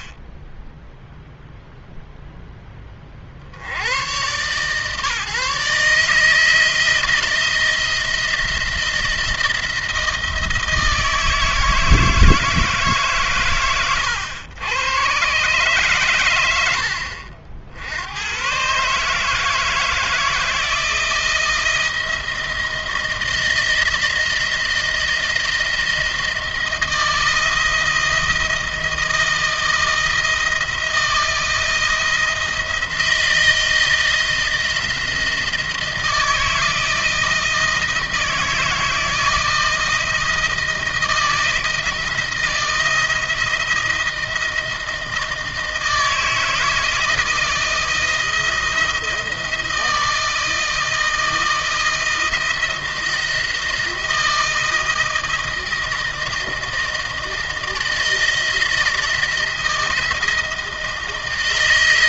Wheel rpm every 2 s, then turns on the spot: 10, 20, 140, 160, 170, 160, 140, 120, 80, 140, 170, 160, 160, 170, 170, 160, 160, 160, 160, 170, 160, 170, 160, 160, 170, 160, 160, 160, 160, 160, 160.
none